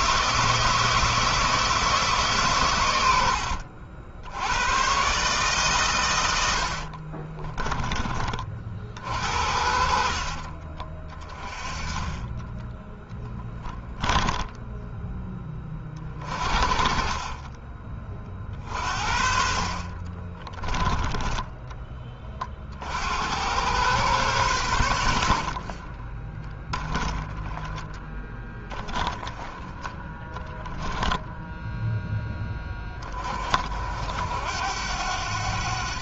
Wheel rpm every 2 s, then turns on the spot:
160, 100, 130, 40, 60, 40, 10, 10, 30, 50, 20, 80, 80, 10, 10, 10, 30, 90.
2-4 6-8 12-14 20-22